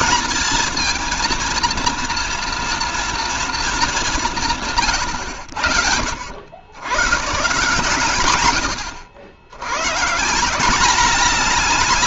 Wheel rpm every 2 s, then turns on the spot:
230, 230, 170, 100, 100, 180.
none